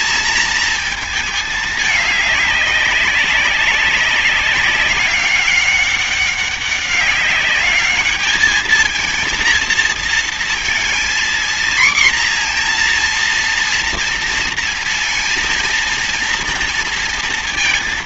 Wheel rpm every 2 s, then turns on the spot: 220, 200, 200, 200, 230, 230, 240, 230, 230.
none